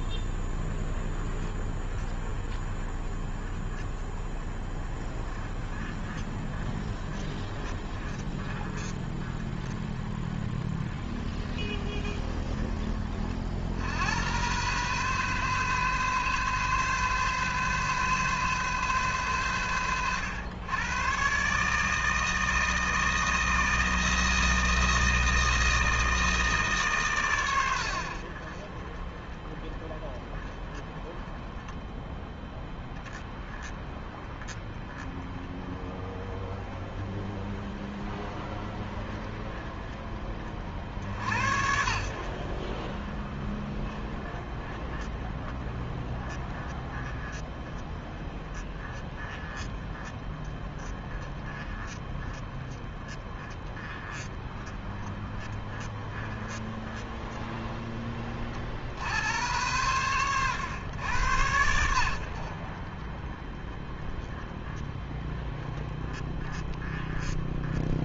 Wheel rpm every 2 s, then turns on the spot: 20, 20, 20, 20, 20, 20, 100, 130, 130, 100, 160, 160, 160, 70, 20, 10, 20, 20, 20, 30, 70, 20, 20, 20, 20, 20, 20, 20, 20, 100, 80, 20, 20, 20.
none